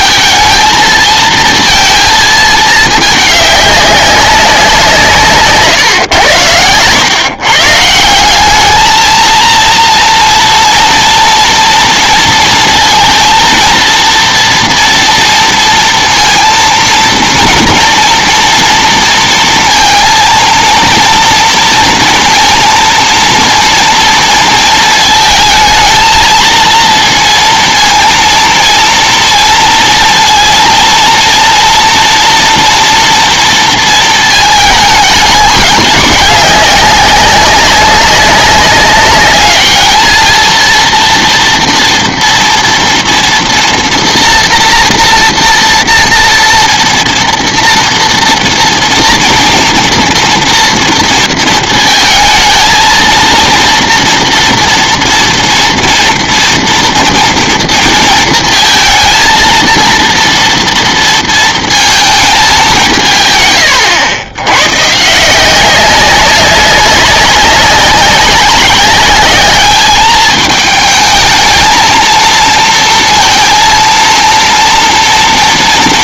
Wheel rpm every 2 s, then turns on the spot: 220, 220, 180, 100, 200, 240, 230, 230, 230, 230, 230, 230, 230, 230, 230, 230, 240, 220, 200, 200, 230, 240, 230, 230, 230, 230, 220, 230, 230, 230, 230, 200, 130, 190, 190, 220, 230, 230.
none